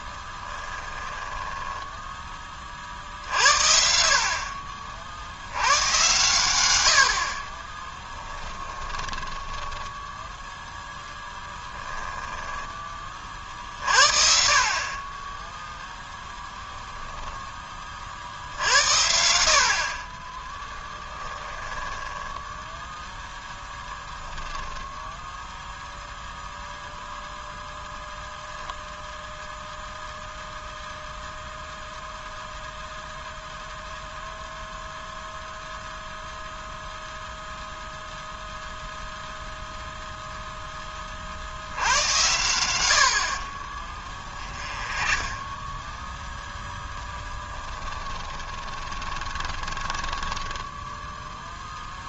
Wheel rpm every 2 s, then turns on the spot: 10, 40, 40, 100, 10, 0, 20, 40, 20, 70, 10, 20, 10, 0, 0, 0, 0, 0, 0, 0, 10, 90, 20, 10, 20, 10.
0-2 4-6 8-10 16-18 20-22 44-46 48-52